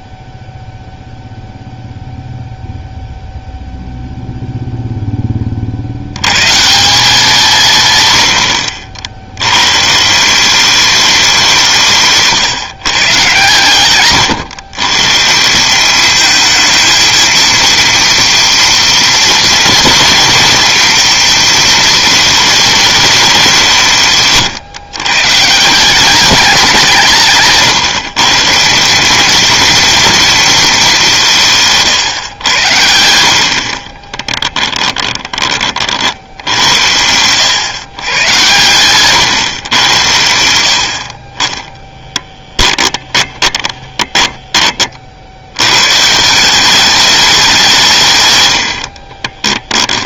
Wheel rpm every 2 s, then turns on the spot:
0, 0, 0, 170, 70, 200, 150, 110, 220, 230, 230, 210, 130, 190, 180, 210, 80, 10, 80, 120, 80, 20, 20, 200, 70.
34-36 38-40 42-44